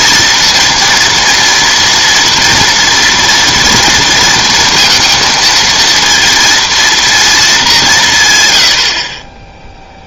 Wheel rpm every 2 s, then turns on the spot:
230, 230, 230, 230, 40.
none